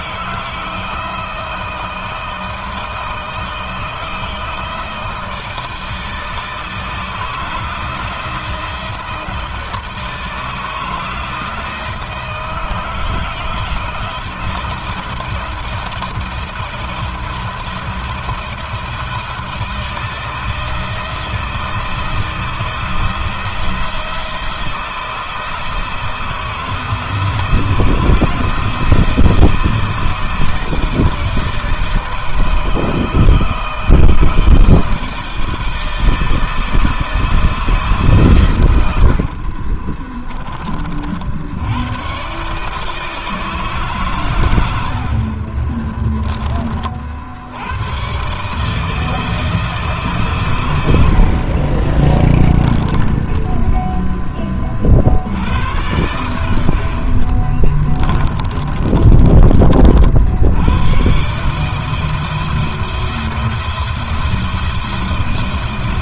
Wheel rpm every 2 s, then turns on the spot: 160, 160, 160, 160, 170, 160, 160, 170, 160, 160, 160, 170, 170, 160, 160, 160, 160, 160, 160, 90, 60, 160, 60, 60, 160, 70, 10, 60, 60, 30, 120, 170, 170.
38-40 44-46 56-60